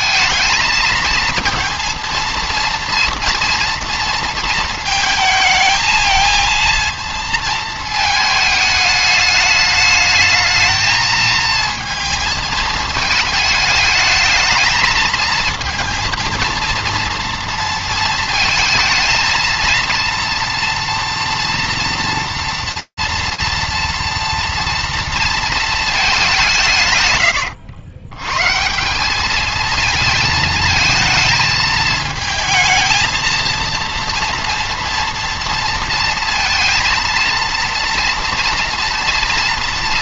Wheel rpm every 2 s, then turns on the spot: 230, 230, 220, 230, 210, 220, 220, 210, 230, 230, 240, 240, 230, 130, 180, 220, 220, 230, 230, 230.
none